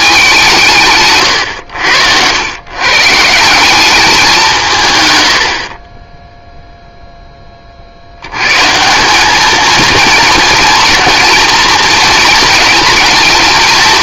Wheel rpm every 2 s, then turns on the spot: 160, 120, 160, 0, 130, 230, 230.
none